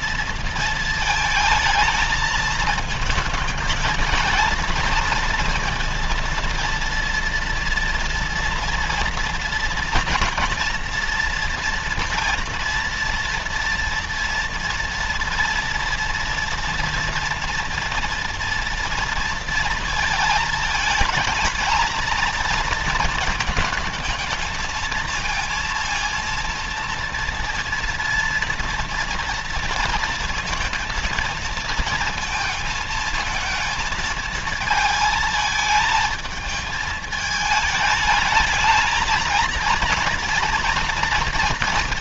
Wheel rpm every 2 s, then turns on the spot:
230, 220, 230, 230, 230, 230, 240, 230, 230, 230, 220, 230, 220, 230, 230, 220, 230, 220, 220, 220, 230.
none